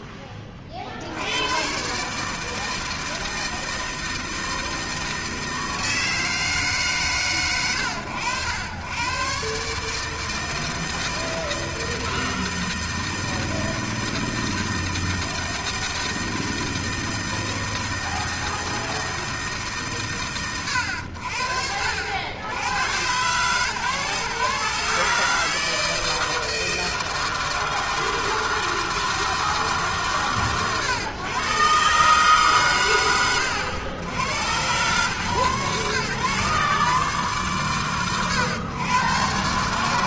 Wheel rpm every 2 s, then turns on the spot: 50, 160, 160, 160, 100, 160, 160, 160, 160, 160, 100, 90, 140, 160, 160, 120, 130, 120, 130, 120.
none